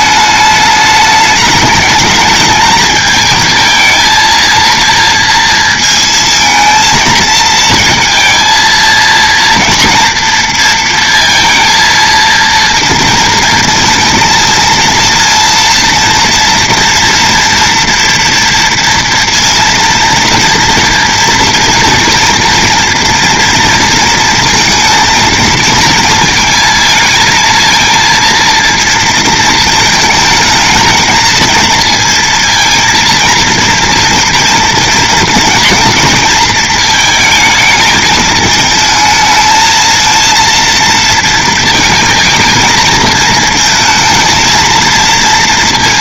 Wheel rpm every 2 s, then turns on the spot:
210, 210, 230, 220, 230, 230, 230, 230, 230, 230, 230, 230, 230, 220, 230, 220, 230, 230, 220, 220, 230, 220, 230.
none